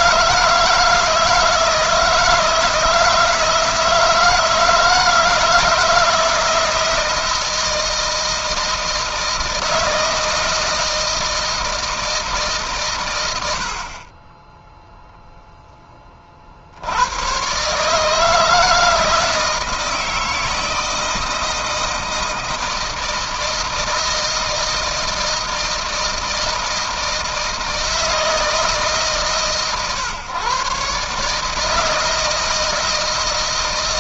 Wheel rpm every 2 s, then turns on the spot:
160, 160, 160, 160, 160, 160, 150, 20, 40, 160, 160, 160, 160, 160, 160, 130, 160.
none